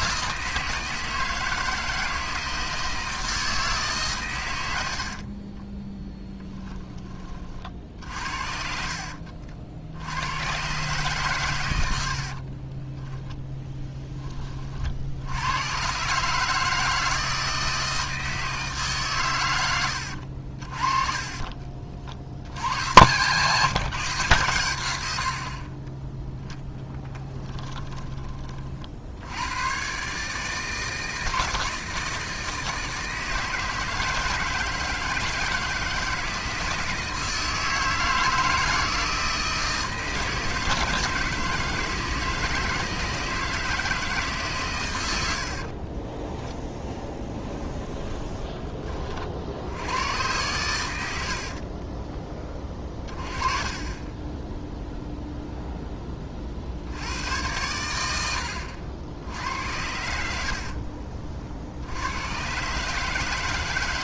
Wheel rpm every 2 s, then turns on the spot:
160, 160, 90, 20, 60, 130, 20, 50, 160, 150, 40, 100, 110, 10, 60, 160, 160, 160, 160, 160, 160, 160, 120, 10, 30, 100, 30, 0, 70, 90, 50, 150.
12-14 20-22 26-28 46-48 52-54 60-62